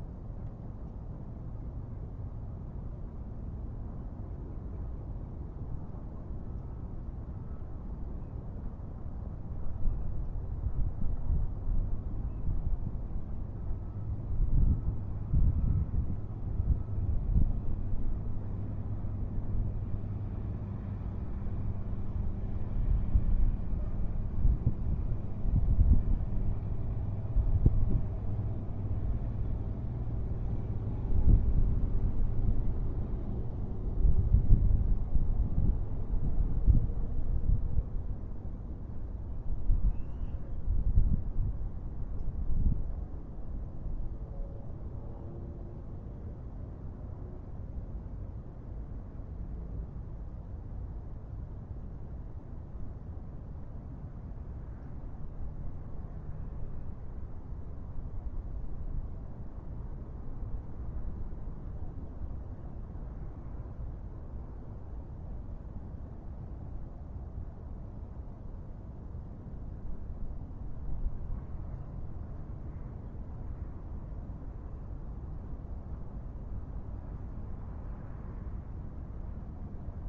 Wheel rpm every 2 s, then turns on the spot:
0, 0, 0, 0, 0, 0, 0, 0, 0, 0, 0, 0, 0, 0, 0, 0, 0, 0, 0, 0, 0, 0, 0, 0, 0, 0, 0, 0, 0, 0, 0, 0, 0, 0, 0, 0, 0, 0, 0, 0.
none